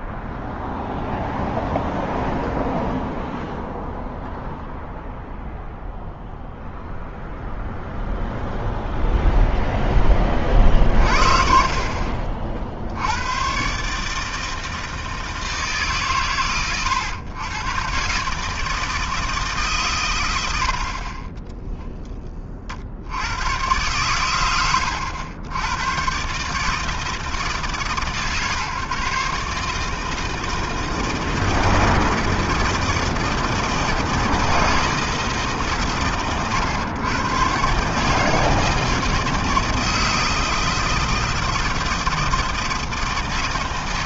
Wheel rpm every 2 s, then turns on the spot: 0, 0, 0, 0, 0, 40, 110, 150, 110, 160, 20, 100, 80, 150, 140, 160, 160, 130, 130, 160, 160, 160.
20-22